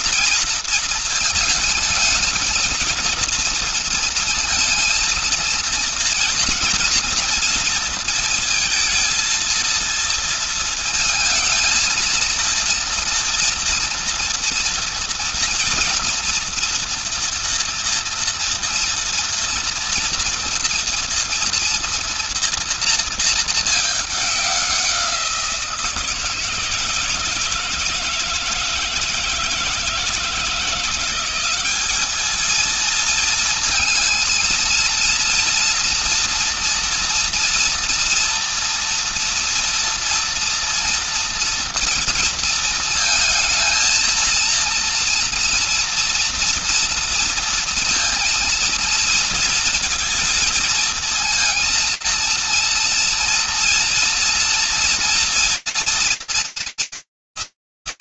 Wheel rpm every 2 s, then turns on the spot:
230, 230, 230, 240, 230, 230, 230, 230, 240, 240, 230, 230, 210, 170, 160, 160, 210, 220, 230, 230, 230, 230, 230, 230, 230, 230, 230, 240, 230.
none